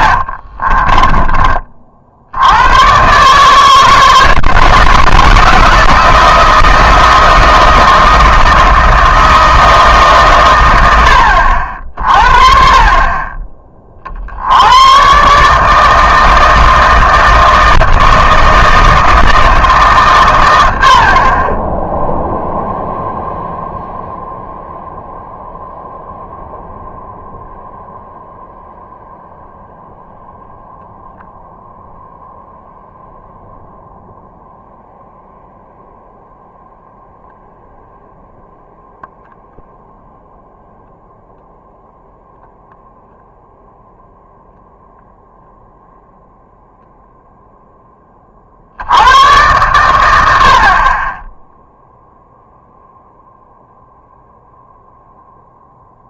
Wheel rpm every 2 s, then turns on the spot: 30, 100, 160, 160, 160, 120, 40, 90, 160, 160, 80, 0, 0, 0, 0, 0, 0, 0, 0, 0, 0, 0, 0, 0, 60, 50, 0, 0.
0-2